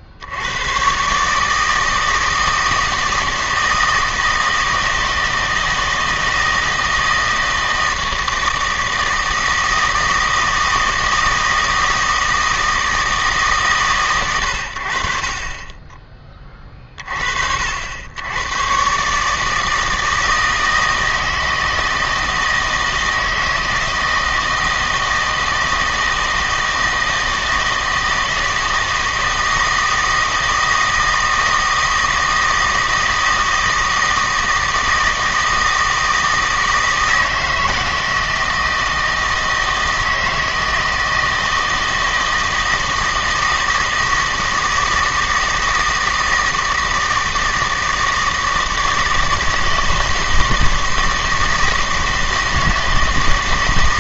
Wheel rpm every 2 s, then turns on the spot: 120, 160, 160, 160, 160, 160, 160, 80, 30, 120, 160, 160, 160, 160, 160, 160, 160, 160, 160, 160, 160, 160, 160, 160, 160, 160, 160.
none